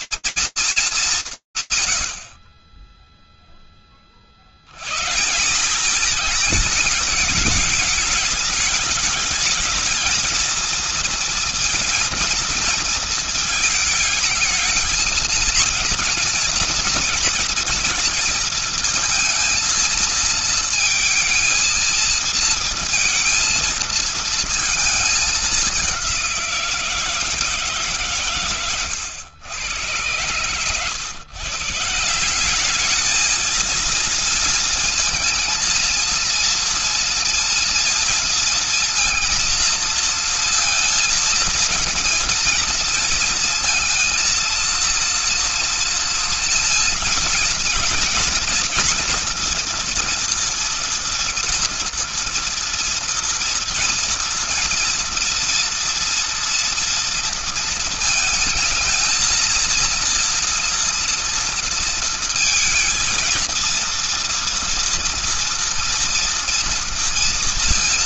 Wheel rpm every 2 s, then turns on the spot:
230, 50, 100, 220, 210, 230, 230, 220, 230, 230, 230, 220, 220, 160, 130, 120, 200, 220, 230, 230, 230, 230, 230, 230, 240, 230, 230, 230, 230, 220, 230, 230, 240, 230.
none